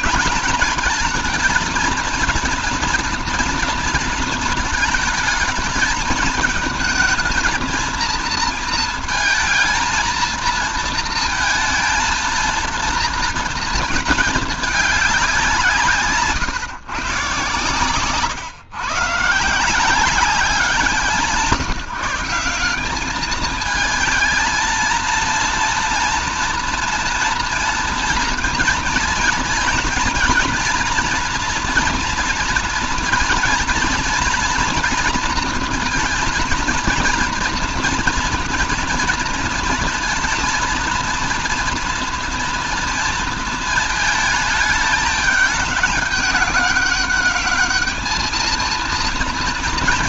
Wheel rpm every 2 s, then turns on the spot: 200, 230, 220, 220, 220, 230, 230, 210, 150, 130, 190, 190, 220, 230, 230, 240, 230, 230, 230, 230, 230, 230, 210, 200, 230.
none